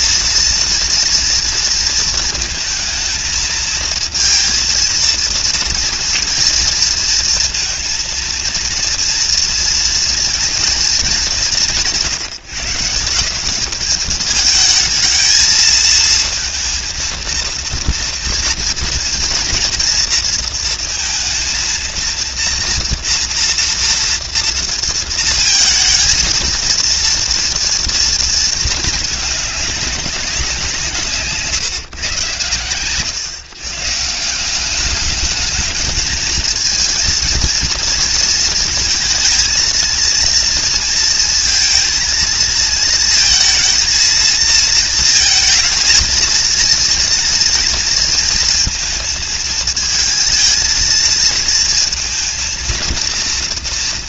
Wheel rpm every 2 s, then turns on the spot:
230, 220, 230, 230, 230, 190, 170, 220, 230, 230, 230, 230, 230, 230, 210, 160, 140, 210, 220, 220, 230, 220, 230, 230, 220, 230, 230.
none